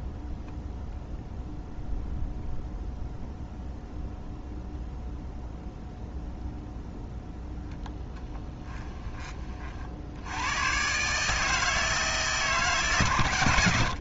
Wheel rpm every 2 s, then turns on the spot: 0, 0, 0, 0, 10, 130, 140.
none